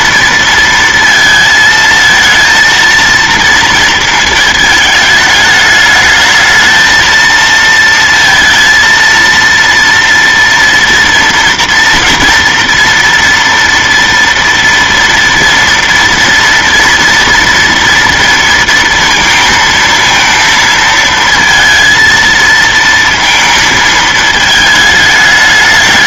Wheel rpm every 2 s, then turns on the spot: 230, 230, 220, 220, 230, 230, 230, 230, 230, 230, 230, 230, 220.
none